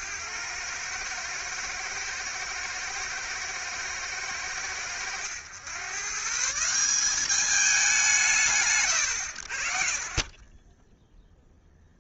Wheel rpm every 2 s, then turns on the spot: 110, 110, 100, 200, 80, 0.
none